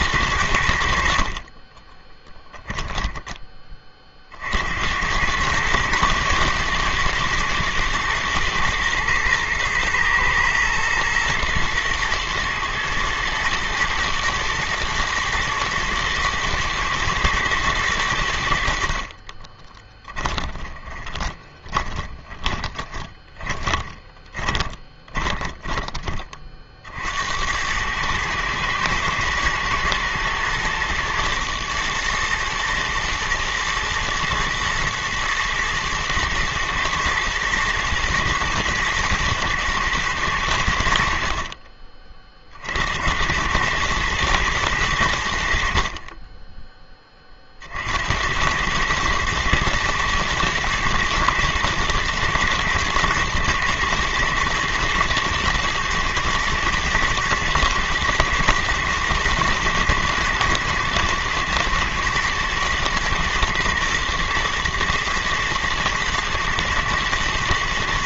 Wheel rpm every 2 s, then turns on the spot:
50, 10, 100, 110, 120, 120, 110, 120, 120, 40, 20, 20, 20, 80, 120, 120, 110, 120, 120, 110, 60, 90, 80, 30, 110, 110, 110, 110, 120, 120, 110, 110, 110, 120.
0-2 20-26